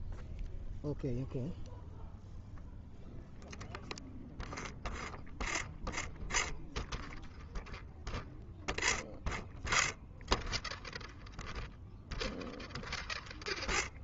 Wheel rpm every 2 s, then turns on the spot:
0, 0, 0, 0, 0, 0, 0.
none